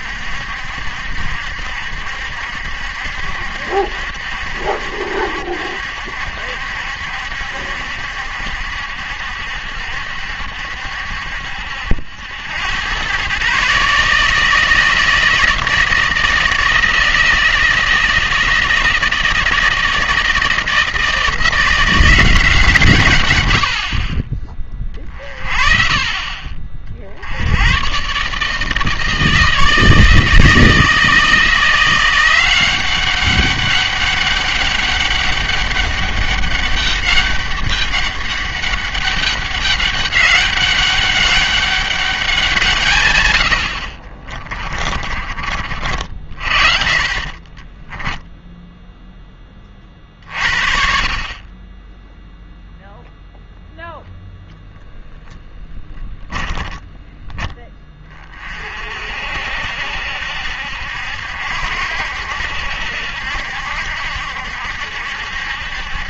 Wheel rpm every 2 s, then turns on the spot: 70, 70, 70, 70, 70, 70, 100, 160, 160, 160, 160, 170, 20, 40, 160, 160, 180, 200, 200, 200, 200, 170, 30, 40, 0, 50, 0, 0, 10, 50, 70, 70, 70.
44-46 56-58